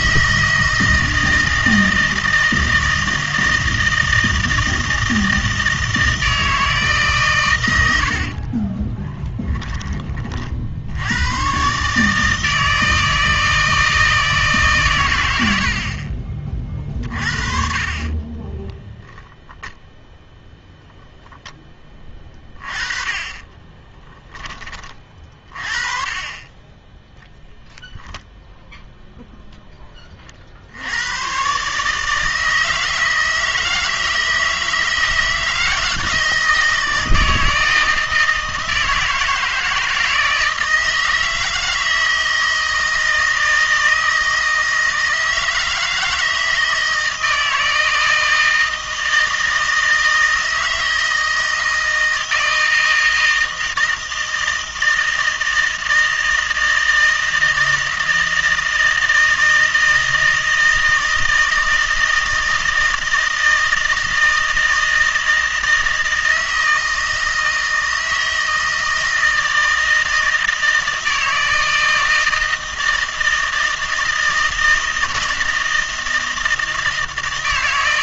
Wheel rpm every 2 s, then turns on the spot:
160, 160, 160, 160, 30, 50, 160, 150, 40, 10, 0, 30, 20, 20, 0, 70, 160, 160, 160, 160, 160, 160, 160, 160, 160, 160, 160, 160, 160, 160, 160, 160, 160, 160, 160, 160, 160, 160, 160.
8-10 18-20